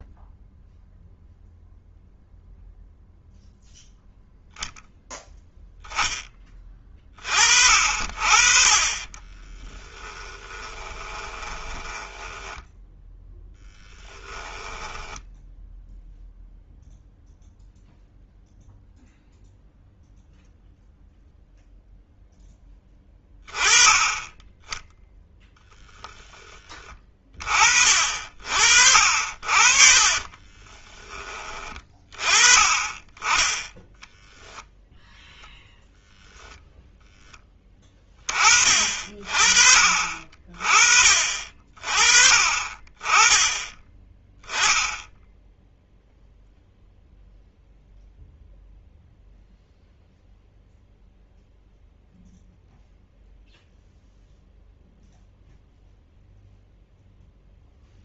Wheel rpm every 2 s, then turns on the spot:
0, 0, 0, 30, 30, 20, 10, 10, 0, 0, 0, 10, 10, 30, 50, 20, 20, 0, 0, 40, 40, 30, 10, 0, 0, 0, 0, 0, 0.
10-12 14-16 28-32